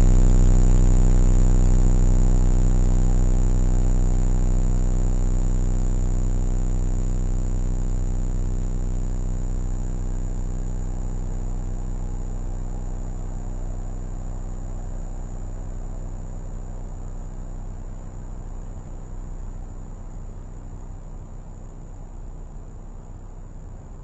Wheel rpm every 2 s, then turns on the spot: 0, 0, 0, 0, 0, 0, 0, 0, 0, 0, 0, 0.
none